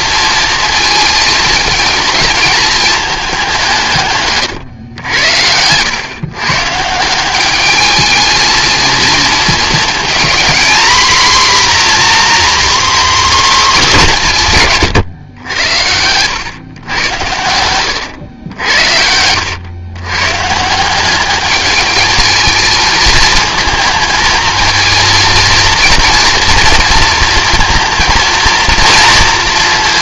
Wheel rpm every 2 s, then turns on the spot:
220, 220, 110, 170, 220, 240, 260, 130, 120, 80, 180, 220, 230, 230, 230.
none